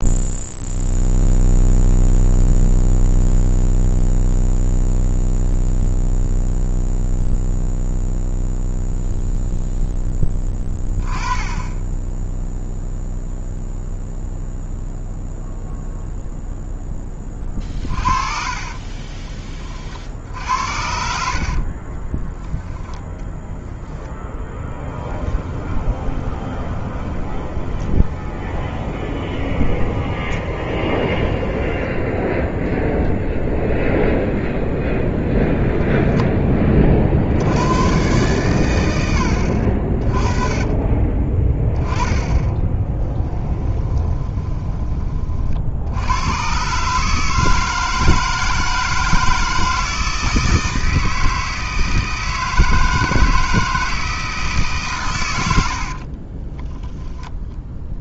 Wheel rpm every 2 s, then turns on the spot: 0, 0, 0, 0, 0, 10, 0, 0, 10, 30, 70, 10, 10, 20, 20, 20, 0, 0, 40, 90, 30, 20, 20, 130, 160, 160, 160, 130, 10.
18-20 24-32 40-44